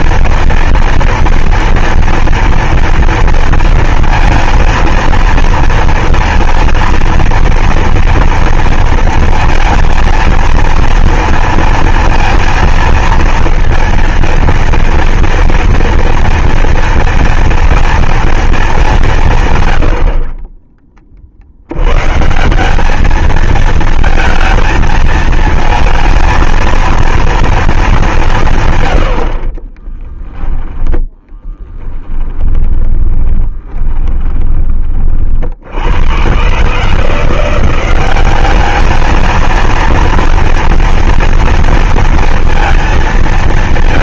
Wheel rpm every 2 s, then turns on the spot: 230, 230, 230, 230, 230, 230, 230, 230, 230, 230, 70, 130, 220, 220, 190, 10, 20, 30, 90, 190, 230, 230.
30-36